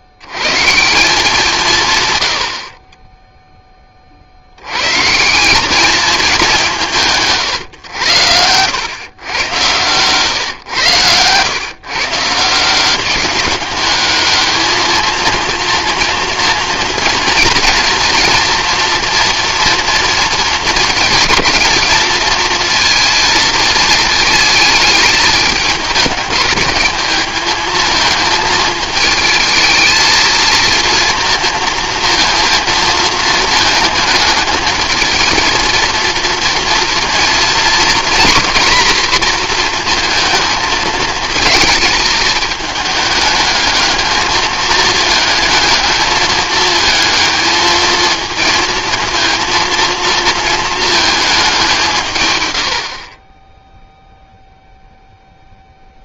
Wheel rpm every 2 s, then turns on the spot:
60, 100, 80, 200, 100, 130, 170, 210, 230, 240, 220, 220, 220, 210, 220, 230, 230, 220, 230, 240, 220, 220, 220, 220, 220, 230, 110, 0.
none